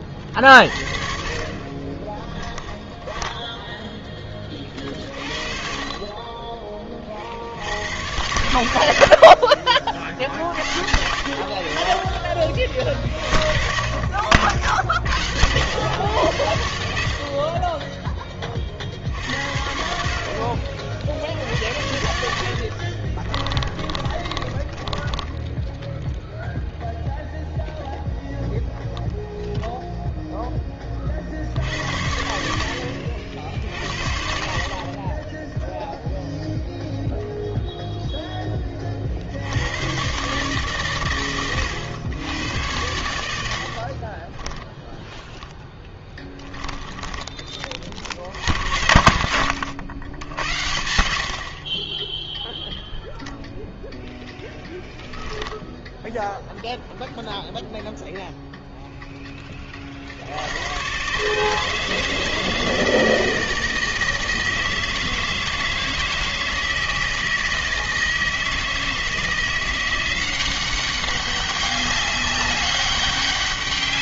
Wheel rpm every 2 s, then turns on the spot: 50, 10, 20, 20, 100, 60, 40, 50, 80, 30, 50, 60, 20, 0, 0, 10, 70, 50, 0, 10, 140, 100, 20, 10, 60, 80, 0, 10, 0, 0, 80, 160, 160, 160, 160, 180, 200.
2-4 22-26 44-48